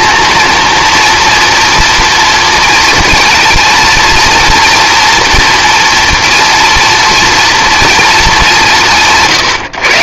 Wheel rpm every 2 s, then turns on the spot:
230, 230, 230, 240, 190.
none